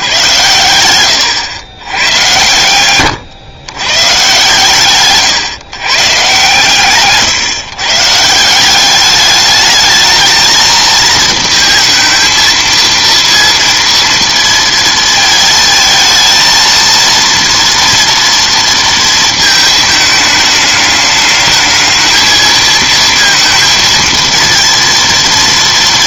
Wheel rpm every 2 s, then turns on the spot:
110, 110, 130, 130, 180, 220, 230, 230, 230, 230, 210, 230, 230.
0-4